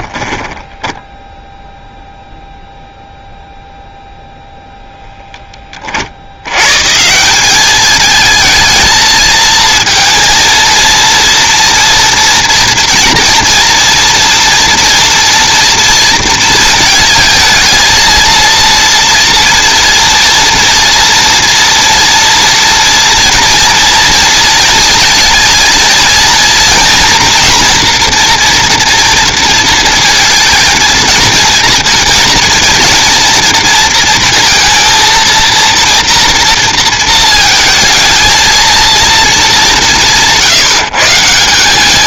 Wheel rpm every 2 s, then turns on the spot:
10, 0, 0, 150, 220, 230, 230, 230, 230, 230, 230, 230, 230, 230, 230, 230, 230, 230, 230, 230, 150.
0-2